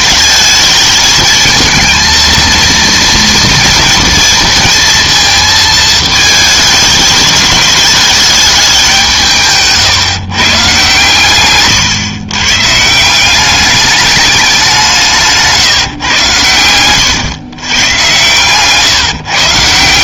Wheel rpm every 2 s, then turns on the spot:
220, 230, 230, 220, 200, 130, 140, 190, 110, 130.
none